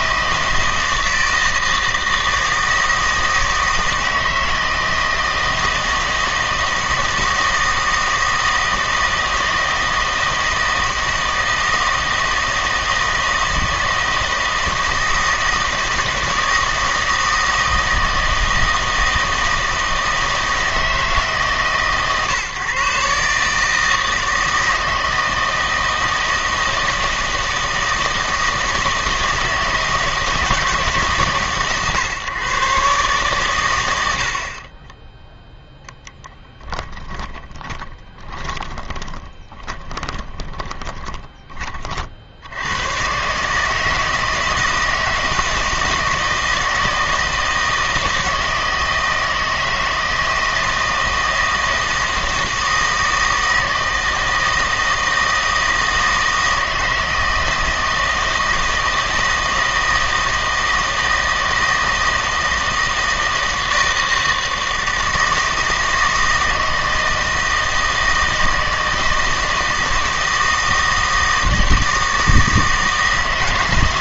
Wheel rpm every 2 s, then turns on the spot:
160, 160, 160, 160, 160, 160, 160, 160, 160, 160, 160, 140, 160, 160, 160, 160, 140, 20, 20, 20, 20, 100, 160, 160, 160, 160, 160, 160, 160, 160, 160, 160, 160, 160, 160, 160, 160.
36-42